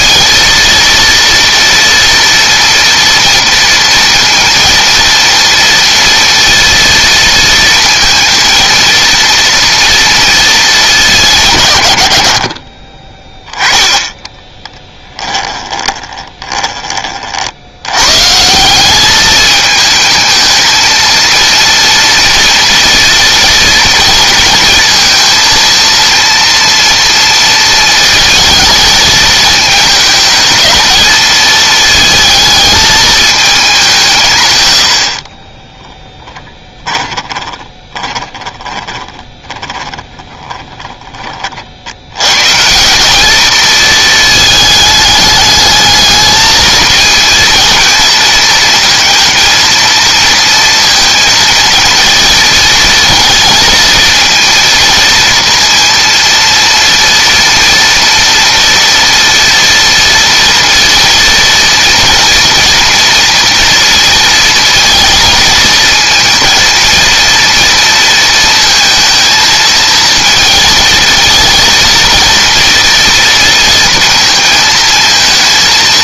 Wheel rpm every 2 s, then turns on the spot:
230, 230, 230, 230, 230, 210, 50, 10, 20, 180, 220, 230, 230, 230, 220, 220, 220, 130, 20, 20, 20, 160, 220, 220, 230, 230, 220, 230, 230, 230, 230, 230, 230, 230, 230, 220, 230, 230.
14-16 36-42